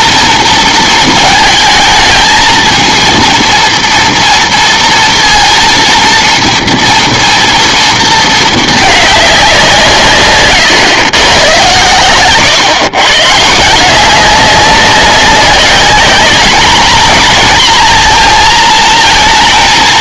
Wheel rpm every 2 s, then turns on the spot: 230, 230, 230, 230, 220, 130, 120, 190, 230, 230.
none